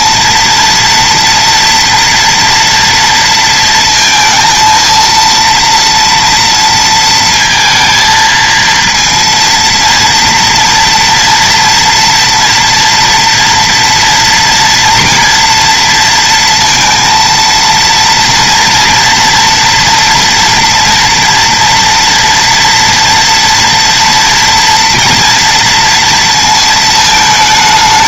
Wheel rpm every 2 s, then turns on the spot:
230, 230, 230, 230, 230, 240, 230, 240, 230, 240, 230, 240, 230, 230.
none